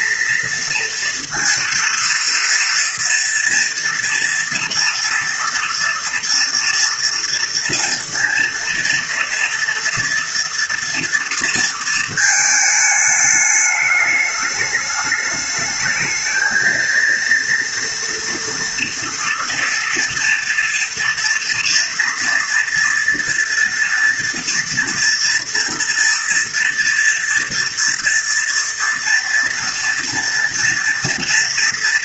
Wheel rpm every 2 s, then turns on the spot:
230, 230, 230, 230, 230, 230, 210, 210, 230, 240, 230, 230, 230, 240, 230, 230.
none